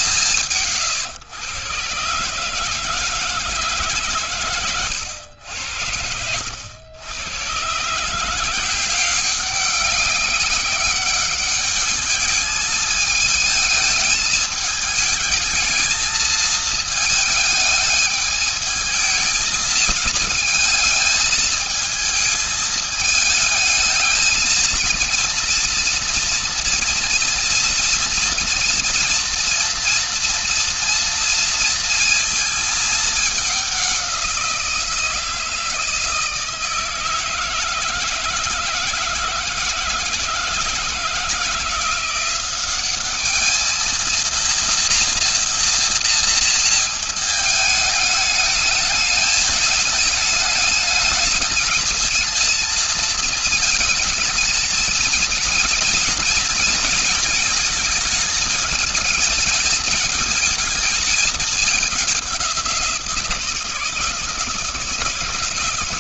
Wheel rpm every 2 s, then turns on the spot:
160, 150, 130, 80, 170, 190, 210, 210, 220, 210, 220, 220, 230, 240, 230, 240, 220, 180, 160, 160, 160, 190, 230, 230, 210, 210, 220, 220, 230, 220, 210, 180, 160.
none